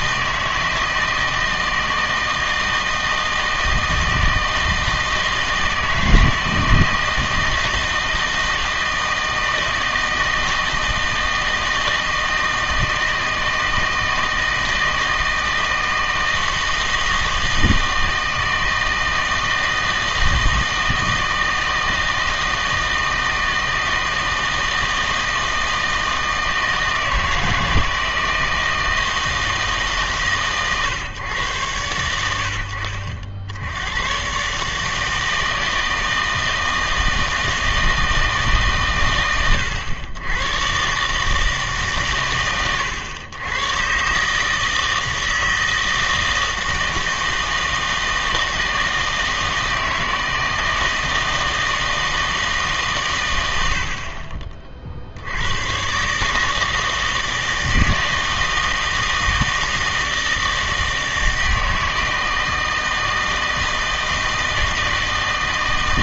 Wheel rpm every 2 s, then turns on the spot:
160, 160, 160, 160, 160, 160, 160, 160, 160, 160, 160, 160, 160, 160, 160, 130, 70, 150, 160, 130, 120, 110, 160, 160, 160, 160, 140, 40, 160, 160, 160, 160, 160.
none